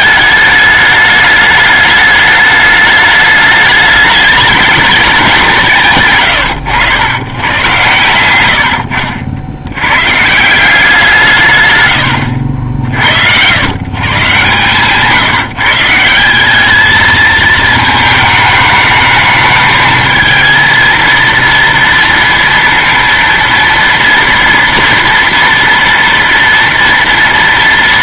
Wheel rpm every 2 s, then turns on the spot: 210, 210, 210, 120, 90, 140, 90, 120, 180, 220, 220, 230, 230, 230.
none